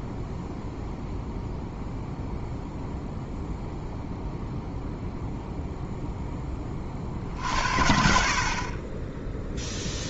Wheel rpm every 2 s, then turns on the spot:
0, 0, 0, 30, 20.
none